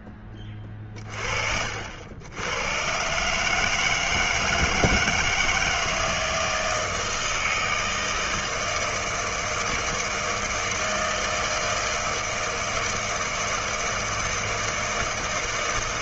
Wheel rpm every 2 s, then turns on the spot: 20, 90, 160, 160, 160, 160, 160, 160.
none